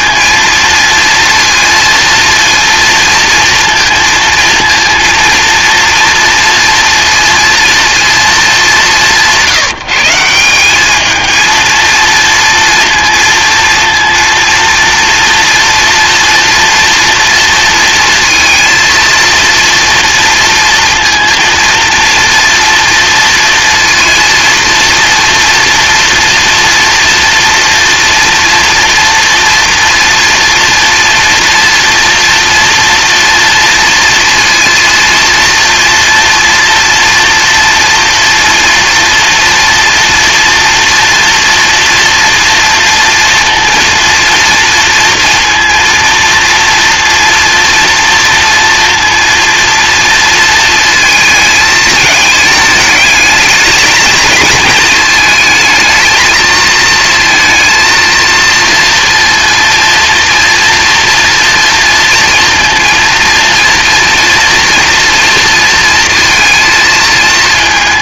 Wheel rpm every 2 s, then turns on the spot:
230, 230, 230, 240, 200, 190, 230, 230, 230, 230, 230, 230, 230, 230, 230, 230, 230, 230, 230, 230, 230, 230, 230, 230, 230, 230, 210, 210, 220, 230, 230, 230, 230, 230.
none